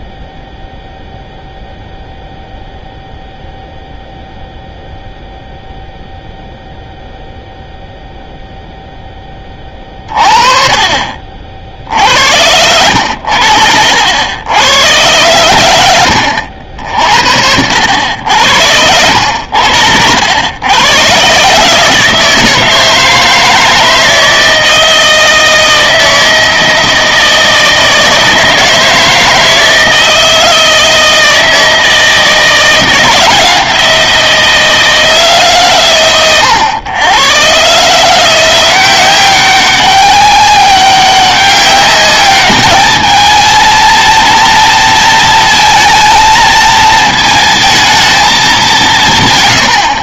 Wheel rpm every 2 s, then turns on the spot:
0, 0, 0, 0, 0, 40, 90, 100, 70, 80, 110, 160, 160, 160, 160, 160, 160, 160, 110, 170, 190, 210, 230, 230, 190.
none